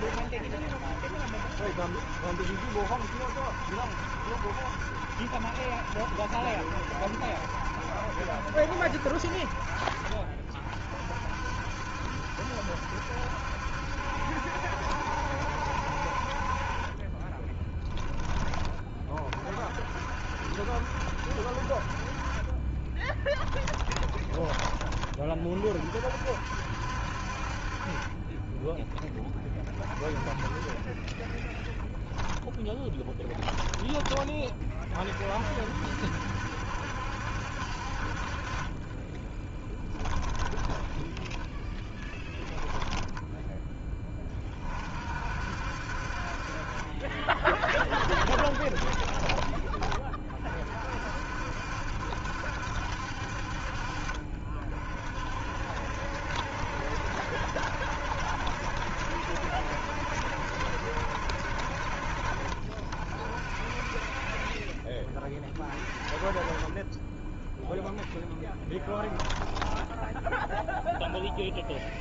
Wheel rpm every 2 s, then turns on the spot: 50, 70, 70, 70, 70, 50, 70, 70, 40, 20, 60, 30, 20, 60, 20, 30, 10, 30, 70, 30, 30, 10, 40, 40, 20, 40, 70, 40, 60, 60, 60, 50, 30, 30, 10, 0.
22-24 28-30 32-34 40-44 48-50 68-70